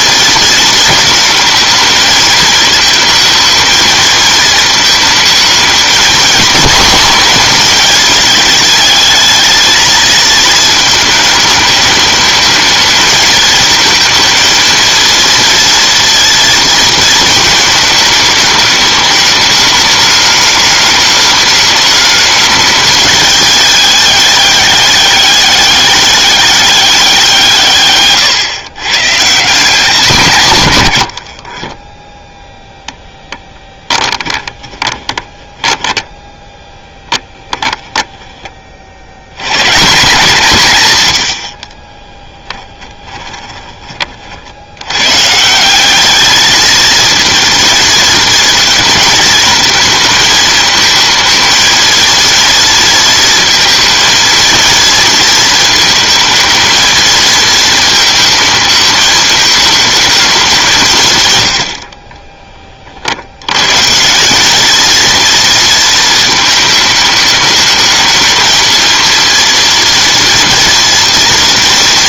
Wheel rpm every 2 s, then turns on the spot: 220, 220, 220, 210, 220, 220, 210, 230, 230, 210, 210, 210, 200, 200, 120, 120, 0, 20, 10, 30, 150, 10, 80, 220, 230, 220, 230, 230, 230, 220, 190, 30, 210, 220, 230, 230.
34-38 42-44